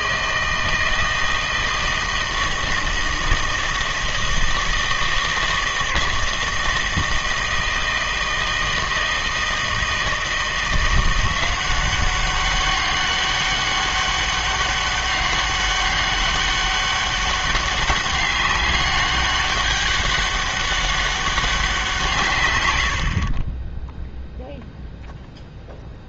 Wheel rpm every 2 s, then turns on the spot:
160, 160, 160, 160, 160, 170, 190, 200, 200, 200, 200, 110, 0.
22-24